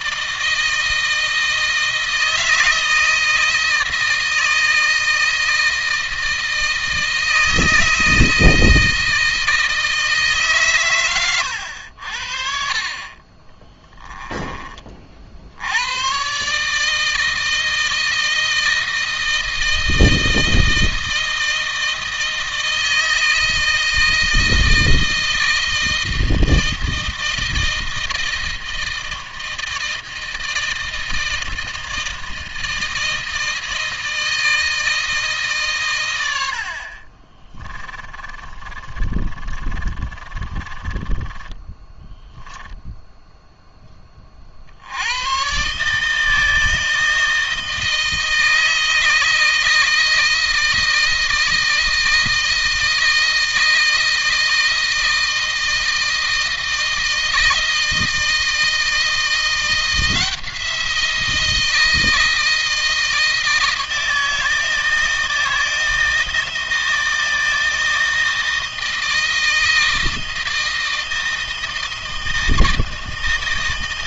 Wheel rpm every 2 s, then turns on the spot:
160, 160, 160, 160, 160, 130, 30, 40, 150, 160, 160, 160, 160, 160, 160, 160, 160, 160, 60, 40, 20, 0, 80, 160, 160, 160, 160, 160, 160, 160, 170, 160, 160, 160, 160, 160, 160.
36-42